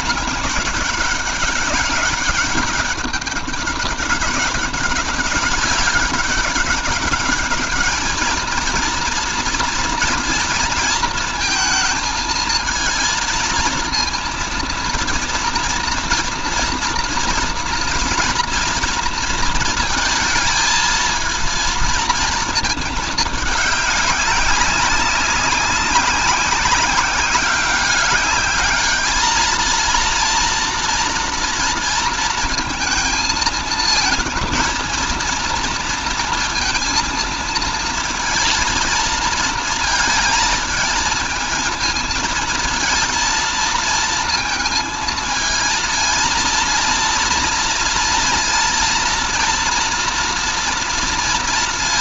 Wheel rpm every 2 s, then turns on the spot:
210, 200, 200, 200, 230, 230, 220, 230, 230, 240, 230, 220, 190, 200, 210, 230, 230, 230, 230, 230, 220, 230, 230, 230, 230, 240.
none